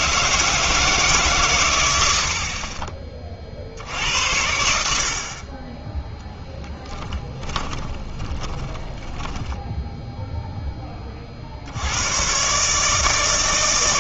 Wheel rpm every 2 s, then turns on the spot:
150, 20, 70, 10, 10, 10, 150.
6-10